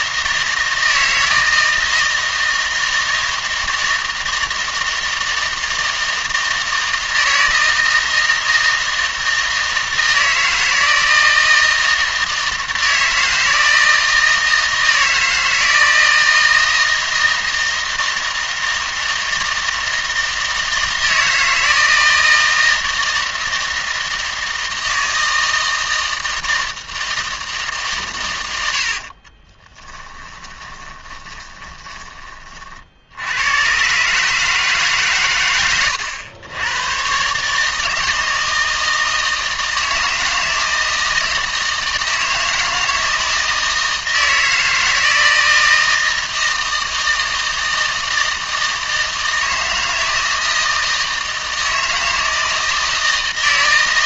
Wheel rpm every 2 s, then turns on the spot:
160, 160, 160, 160, 160, 160, 160, 160, 160, 160, 160, 160, 160, 160, 70, 20, 40, 150, 100, 160, 160, 160, 160, 160, 160, 160, 160.
28-32